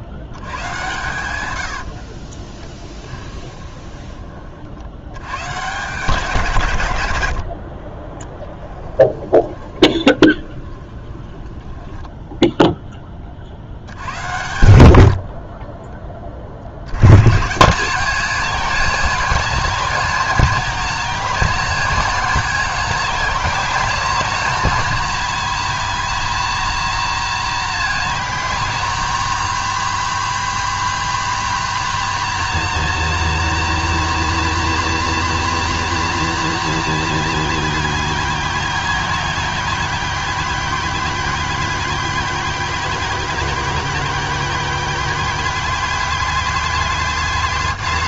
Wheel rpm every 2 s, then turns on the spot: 110, 10, 70, 120, 10, 20, 10, 70, 90, 240, 240, 240, 240, 240, 250, 260, 250, 250, 240, 240, 230, 230, 230, 250.
2-4 8-12